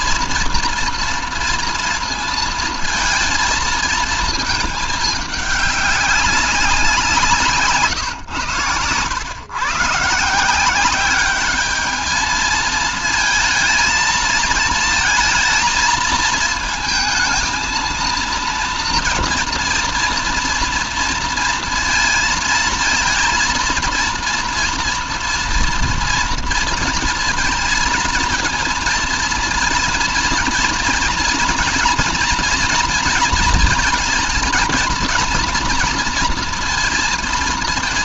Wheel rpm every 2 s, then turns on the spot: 230, 230, 210, 170, 120, 190, 220, 230, 220, 230, 230, 220, 230, 230, 230, 230, 230, 230, 230.
none